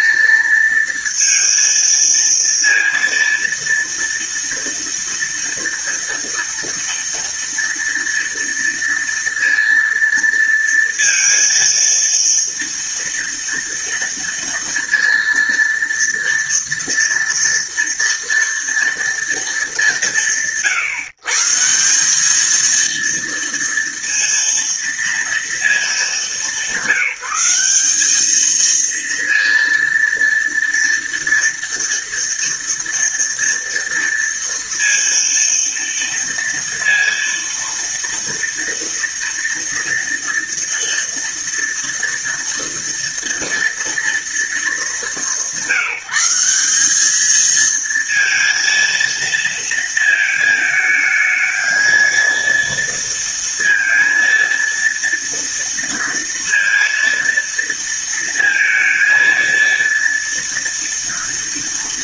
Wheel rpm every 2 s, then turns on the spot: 230, 230, 230, 230, 230, 230, 230, 230, 230, 230, 150, 230, 230, 190, 230, 230, 230, 230, 230, 230, 230, 230, 210, 200, 230, 220, 230, 230, 230, 230, 230.
none